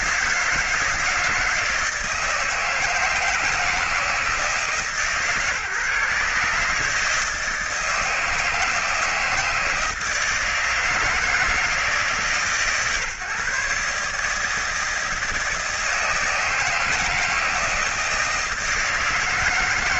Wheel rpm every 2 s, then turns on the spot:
160, 160, 150, 150, 160, 160, 150, 160, 160, 160.
none